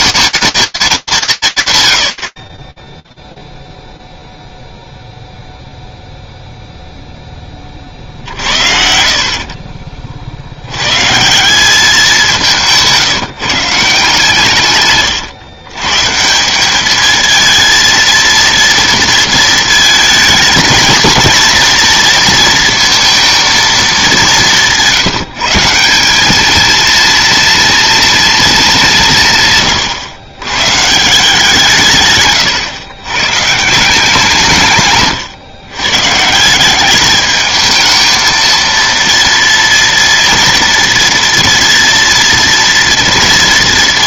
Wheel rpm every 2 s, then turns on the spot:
220, 40, 0, 0, 50, 70, 170, 150, 200, 230, 210, 220, 170, 230, 200, 140, 120, 140, 190, 230, 230, 230.
2-4